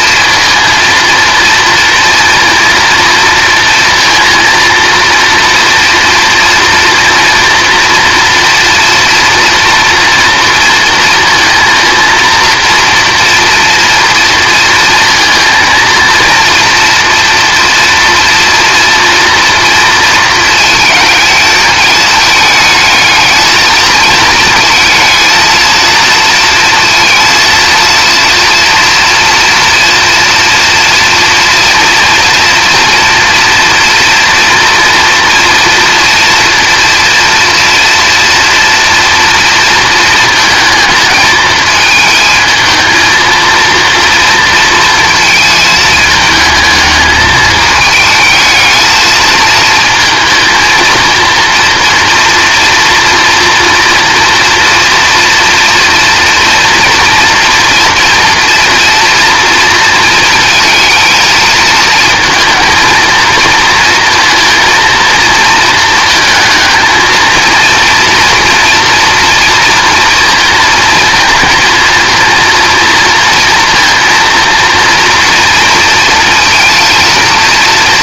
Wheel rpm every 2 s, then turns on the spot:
230, 230, 230, 230, 230, 230, 230, 230, 240, 240, 220, 220, 220, 230, 230, 230, 230, 230, 230, 230, 220, 220, 230, 220, 220, 230, 230, 230, 230, 230, 220, 220, 230, 220, 240, 220, 230, 230, 230.
none